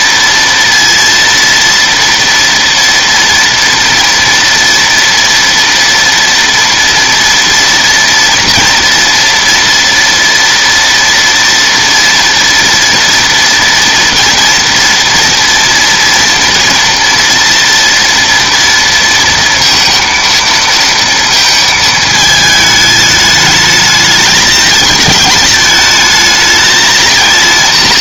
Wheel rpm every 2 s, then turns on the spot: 230, 230, 230, 230, 240, 230, 230, 230, 240, 230, 230, 220, 220, 220.
none